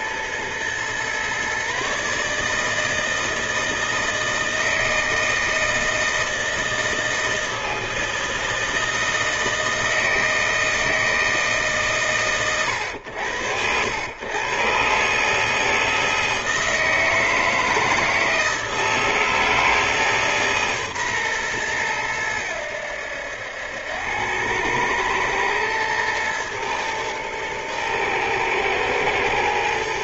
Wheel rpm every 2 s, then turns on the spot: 120, 150, 160, 160, 160, 160, 120, 120, 160, 160, 140, 90, 100, 120, 110.
none